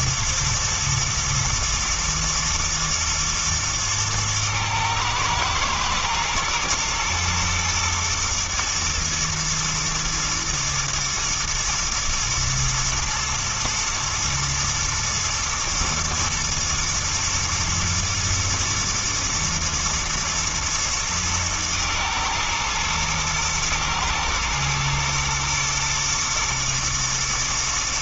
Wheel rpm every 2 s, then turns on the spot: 110, 110, 110, 110, 120, 110, 110, 110, 110, 110, 110, 110, 120, 120.
none